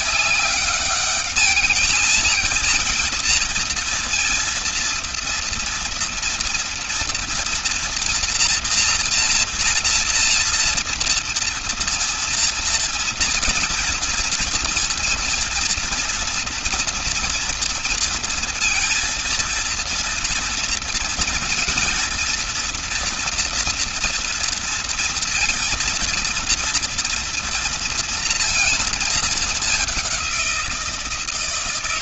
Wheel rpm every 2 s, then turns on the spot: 200, 230, 230, 230, 230, 230, 230, 230, 230, 230, 230, 230, 230, 230, 230, 170.
none